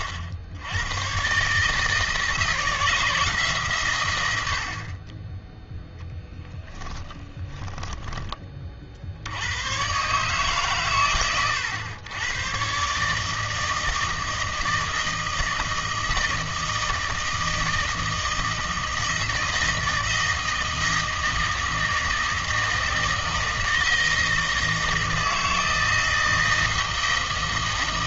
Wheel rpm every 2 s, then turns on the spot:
100, 160, 60, 10, 50, 130, 120, 160, 160, 160, 160, 160, 160, 160.
6-8